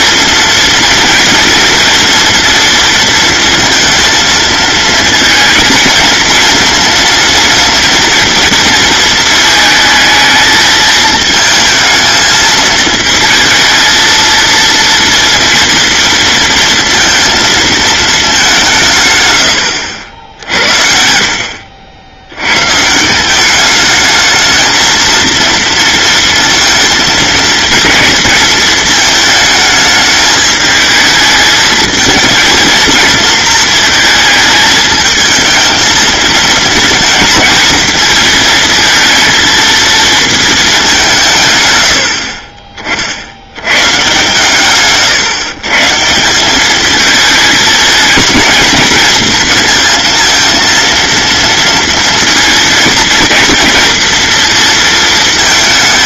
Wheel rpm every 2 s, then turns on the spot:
230, 230, 230, 230, 230, 220, 220, 230, 230, 160, 70, 150, 220, 230, 220, 220, 230, 220, 230, 230, 200, 40, 130, 210, 230, 230, 230, 230.
none